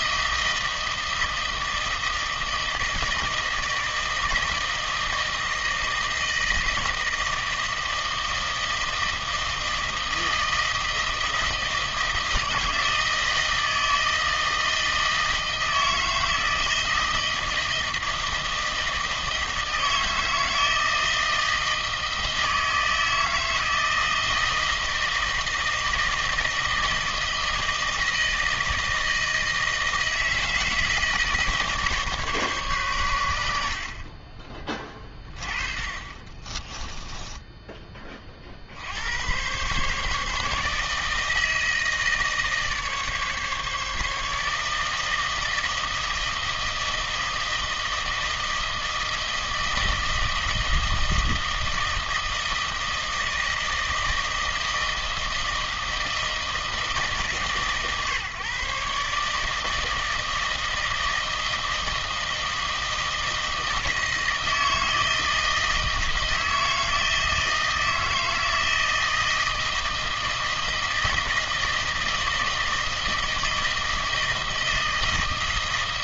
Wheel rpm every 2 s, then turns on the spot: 160, 160, 160, 160, 160, 160, 160, 160, 160, 160, 160, 160, 160, 160, 160, 160, 130, 20, 20, 50, 150, 150, 150, 160, 160, 160, 160, 160, 160, 140, 160, 160, 160, 160, 160, 160, 160, 160.
36-38